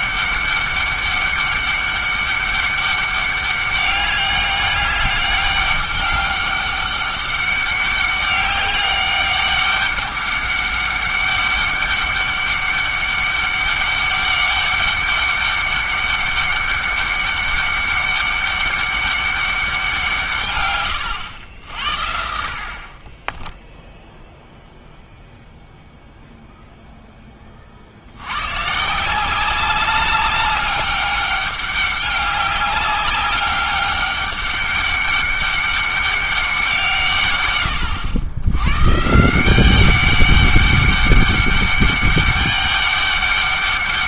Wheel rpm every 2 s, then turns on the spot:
200, 200, 200, 200, 200, 200, 200, 200, 200, 200, 120, 40, 0, 0, 130, 200, 200, 200, 170, 110, 200, 200.
none